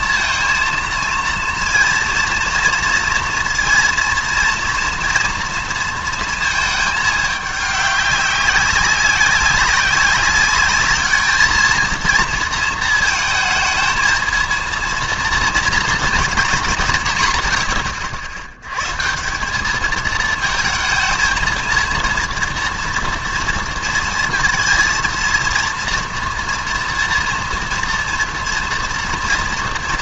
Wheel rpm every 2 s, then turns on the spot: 230, 230, 230, 220, 200, 200, 230, 230, 180, 100, 220, 230, 230, 230, 230.
none